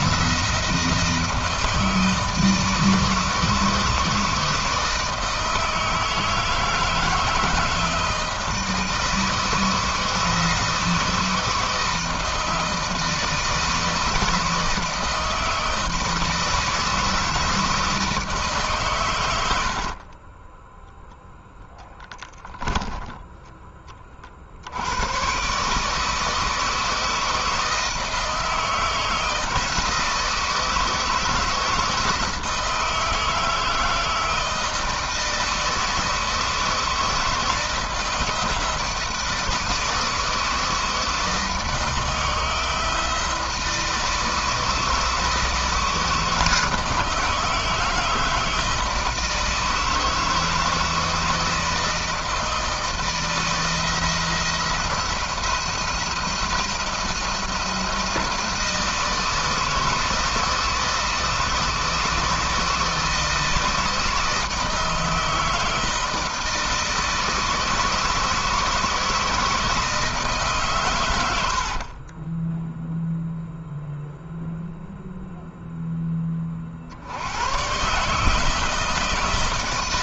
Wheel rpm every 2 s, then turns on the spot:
160, 160, 160, 160, 160, 160, 160, 160, 170, 110, 0, 10, 100, 160, 160, 160, 160, 160, 160, 160, 160, 160, 160, 160, 160, 160, 160, 170, 160, 160, 160, 160, 160, 160, 160, 100, 0, 0, 80, 160.
none